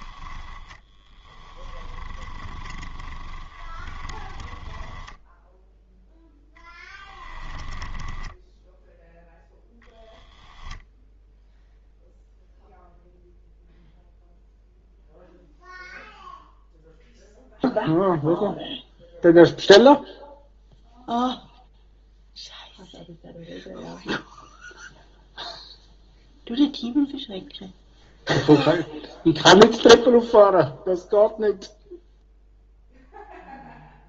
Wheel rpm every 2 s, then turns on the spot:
10, 20, 10, 10, 0, 0, 0, 0, 0, 0, 0, 0, 0, 0, 0, 0, 0.
0-8